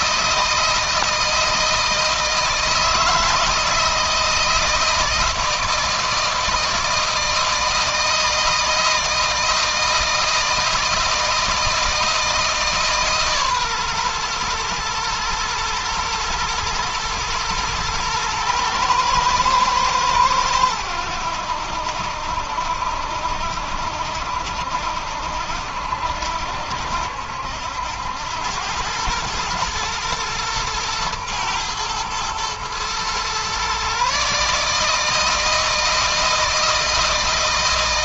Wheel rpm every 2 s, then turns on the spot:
160, 160, 160, 160, 160, 160, 150, 120, 120, 120, 100, 70, 70, 70, 90, 110, 120, 150, 160.
none